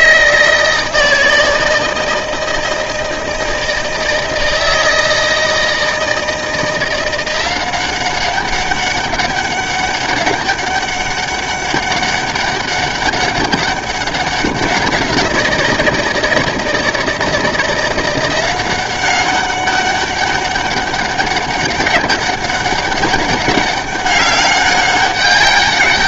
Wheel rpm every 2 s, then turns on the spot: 160, 160, 160, 170, 200, 200, 200, 190, 160, 180, 200, 200, 200.
none